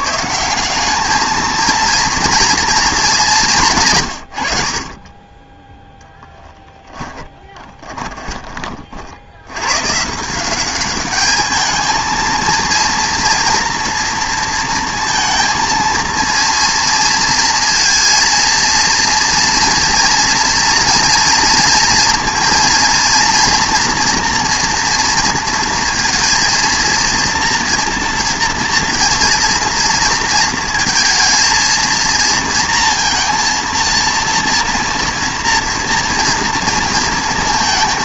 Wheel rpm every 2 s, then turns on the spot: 200, 230, 70, 10, 30, 180, 230, 230, 240, 230, 230, 230, 230, 230, 230, 230, 230, 230, 230.
6-8